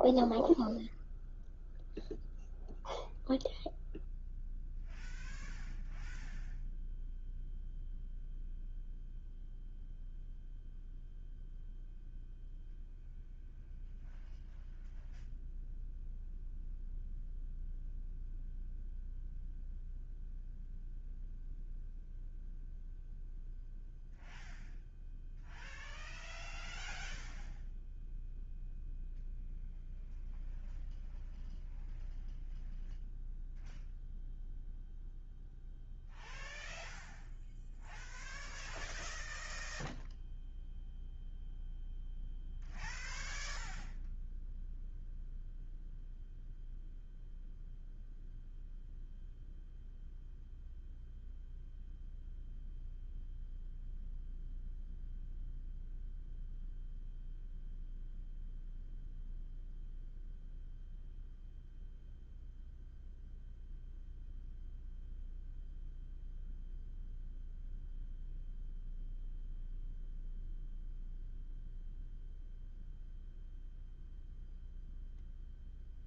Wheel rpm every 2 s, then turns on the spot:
0, 0, 0, 0, 0, 0, 0, 0, 0, 0, 0, 0, 0, 0, 0, 0, 0, 0, 0, 0, 0, 0, 0, 0, 0, 0, 0, 0, 0, 0, 0, 0, 0, 0, 0, 0, 0, 0.
none